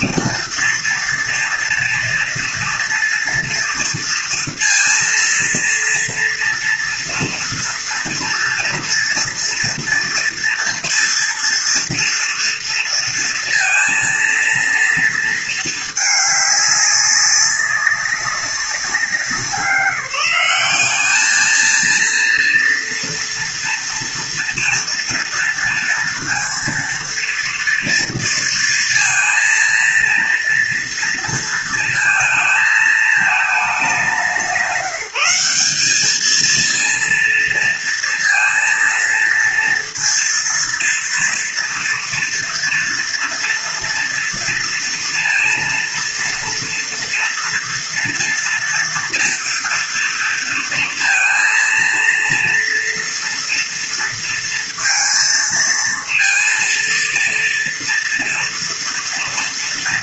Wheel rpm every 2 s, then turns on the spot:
230, 230, 230, 230, 240, 230, 230, 230, 200, 190, 200, 230, 230, 230, 230, 230, 220, 170, 230, 230, 230, 230, 230, 230, 230, 230, 230, 230, 230, 240.
none